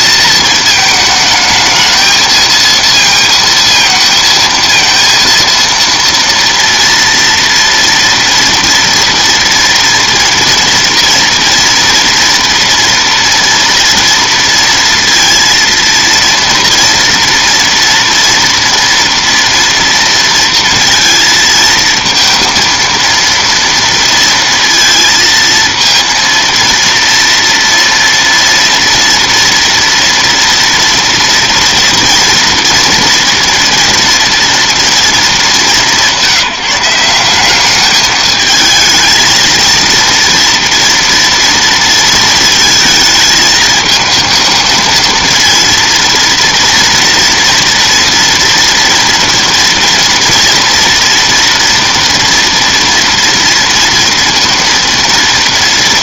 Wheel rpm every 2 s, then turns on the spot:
220, 230, 230, 230, 230, 230, 230, 230, 230, 230, 230, 230, 230, 230, 230, 230, 230, 230, 170, 220, 230, 230, 220, 230, 230, 230, 230, 230.
none